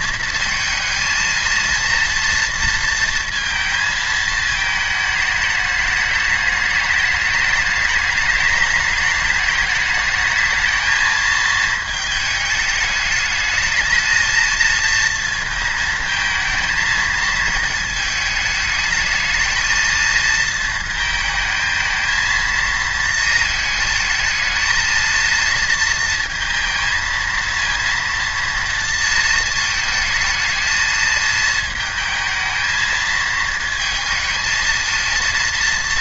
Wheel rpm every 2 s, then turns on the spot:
230, 230, 210, 210, 210, 220, 210, 230, 230, 220, 230, 230, 220, 230, 230, 220, 220, 220.
none